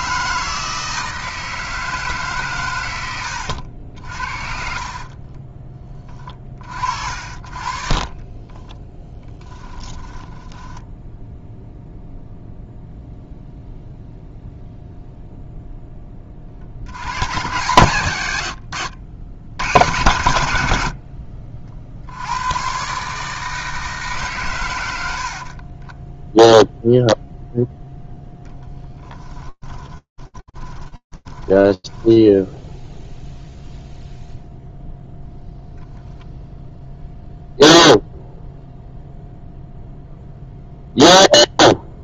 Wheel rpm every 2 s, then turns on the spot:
160, 150, 50, 30, 30, 10, 0, 0, 20, 100, 110, 90, 140, 10, 10, 10, 0, 0, 0, 0, 0.
4-6 8-12 26-32